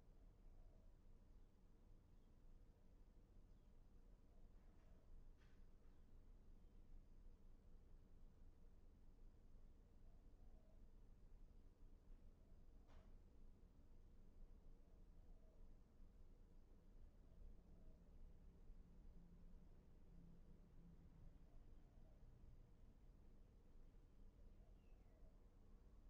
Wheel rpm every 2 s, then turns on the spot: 0, 0, 0, 0, 0, 0, 0, 0, 0, 0, 0, 0, 0.
none